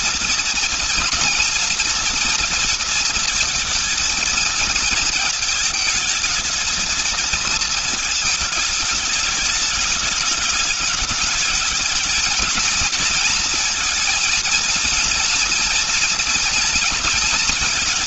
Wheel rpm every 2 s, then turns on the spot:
230, 230, 220, 220, 210, 220, 220, 230, 220.
none